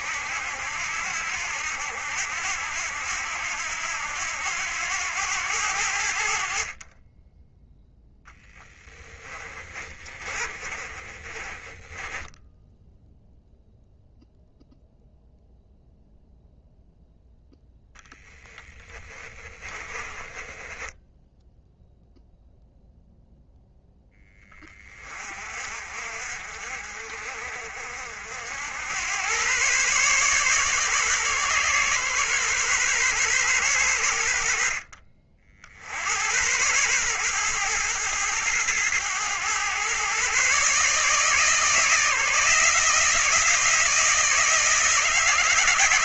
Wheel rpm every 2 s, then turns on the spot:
80, 80, 90, 40, 20, 30, 0, 0, 0, 10, 10, 0, 20, 50, 90, 140, 130, 50, 110, 110, 140, 160, 160.
8-12 18-22